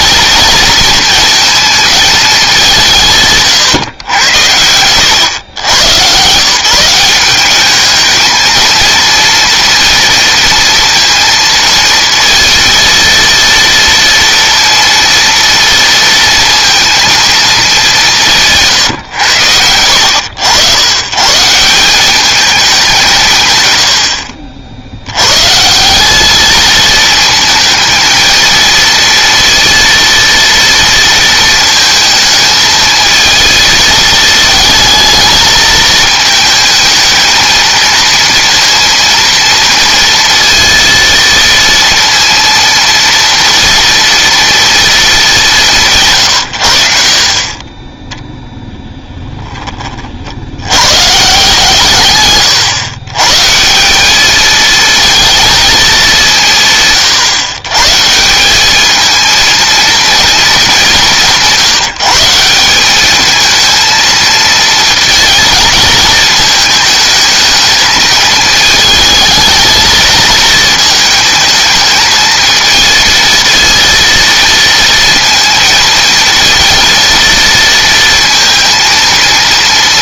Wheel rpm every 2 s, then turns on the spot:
230, 180, 100, 170, 230, 230, 230, 230, 230, 150, 100, 190, 80, 220, 230, 230, 220, 220, 220, 230, 230, 230, 230, 60, 10, 110, 120, 230, 140, 220, 190, 200, 230, 220, 220, 220, 220, 230, 230, 230.
18-20